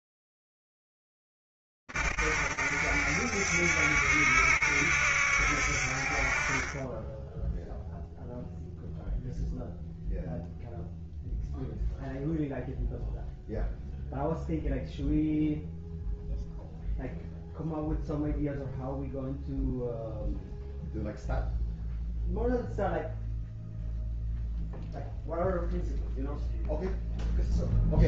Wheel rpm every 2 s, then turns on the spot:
20, 70, 70, 60, 0, 0, 0, 0, 0, 0, 0, 0, 0, 0.
none